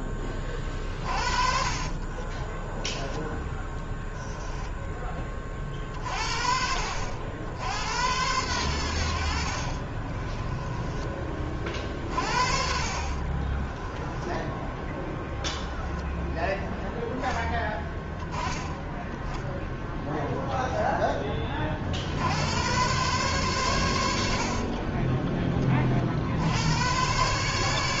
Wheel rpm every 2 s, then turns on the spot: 30, 20, 20, 50, 90, 20, 40, 10, 10, 10, 10, 100, 40, 100.
0-4 10-14 24-26